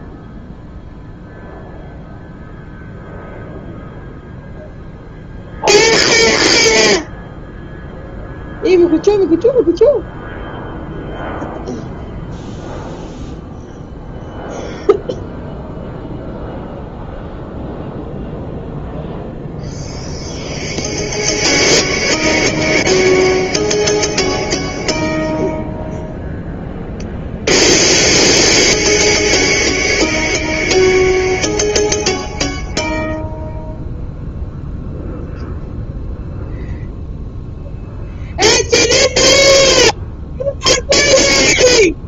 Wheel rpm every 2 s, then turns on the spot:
0, 0, 0, 0, 0, 0, 0, 0, 0, 0, 0, 0, 0, 0, 0, 0, 0, 0, 0, 0, 0.
none